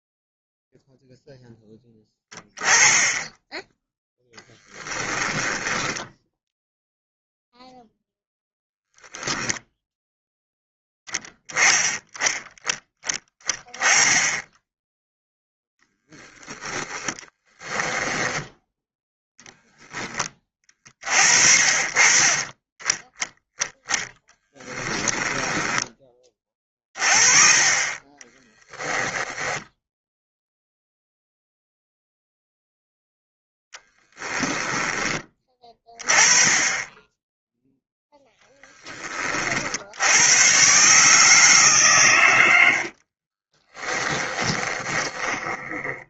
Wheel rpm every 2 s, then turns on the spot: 0, 10, 10, 0, 0, 10, 10, 10, 10, 0, 30, 10, 10, 30, 10, 0, 0, 10, 20, 10, 130, 80, 20.
4-6 24-26 28-30 42-46